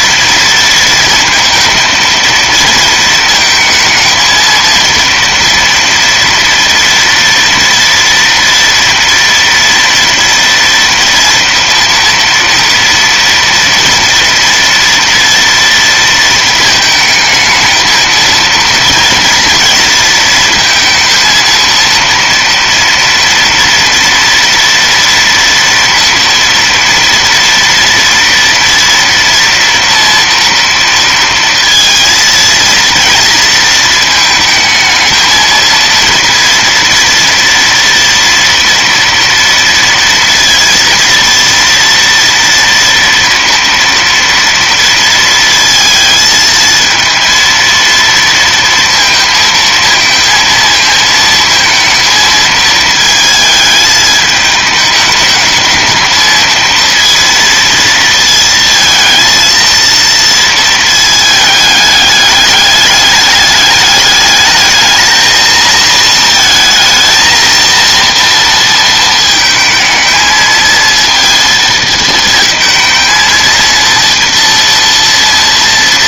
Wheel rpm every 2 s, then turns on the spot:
230, 220, 230, 230, 230, 230, 230, 230, 220, 230, 230, 240, 230, 230, 230, 230, 230, 220, 230, 230, 230, 230, 230, 220, 230, 220, 220, 210, 230, 220, 220, 200, 220, 220, 230, 230, 220, 230.
none